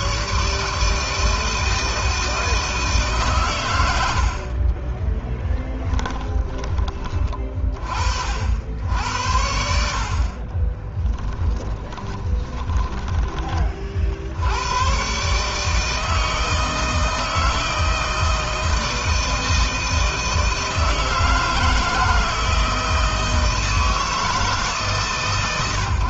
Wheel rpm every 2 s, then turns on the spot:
150, 160, 40, 20, 70, 20, 20, 100, 160, 160, 160, 160, 150.
4-6 10-14